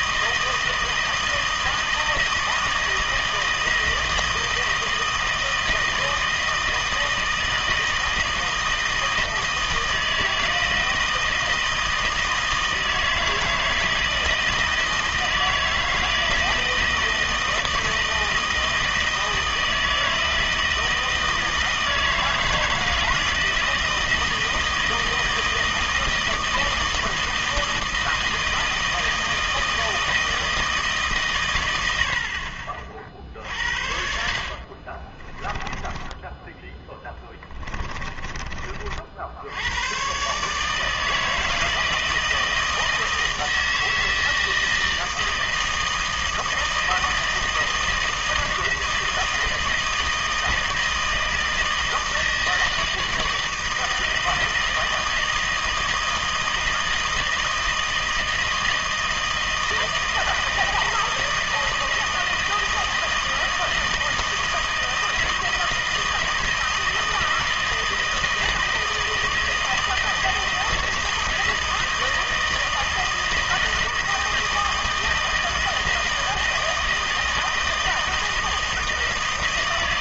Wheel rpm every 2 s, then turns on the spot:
160, 160, 160, 160, 160, 160, 160, 160, 160, 160, 160, 160, 160, 160, 160, 160, 50, 40, 10, 30, 150, 160, 160, 160, 160, 160, 160, 160, 160, 160, 160, 160, 160, 160, 160, 160, 160, 160, 160, 160.
34-38